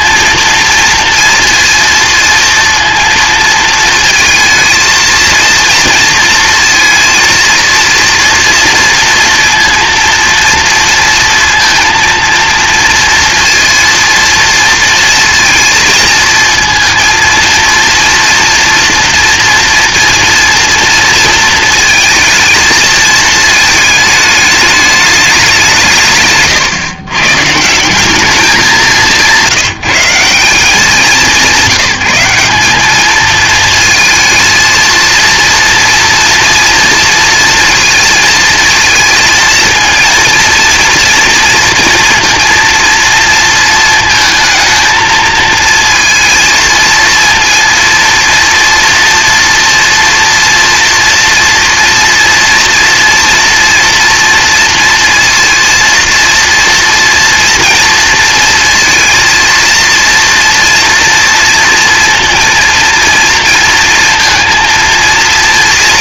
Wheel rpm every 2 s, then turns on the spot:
230, 230, 230, 230, 230, 230, 230, 230, 220, 230, 230, 220, 210, 130, 190, 160, 200, 220, 230, 230, 240, 230, 220, 230, 230, 230, 230, 230, 230, 230, 230, 230, 230.
none